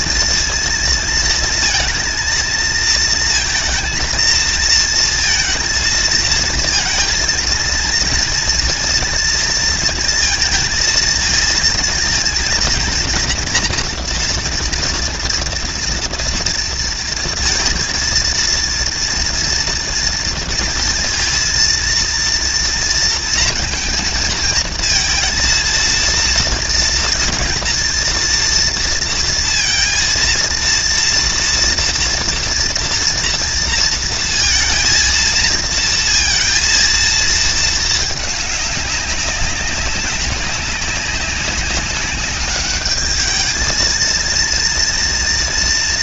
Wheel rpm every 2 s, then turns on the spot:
230, 230, 230, 230, 230, 230, 230, 230, 230, 230, 230, 230, 230, 230, 230, 230, 230, 230, 230, 210, 200, 200, 230.
none